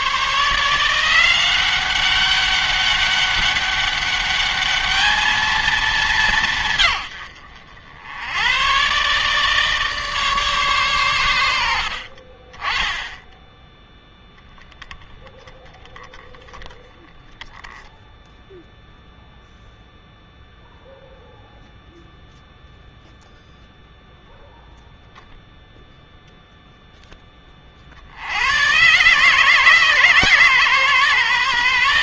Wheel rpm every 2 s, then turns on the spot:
160, 200, 210, 160, 110, 140, 20, 10, 20, 0, 0, 0, 0, 0, 110, 140.
none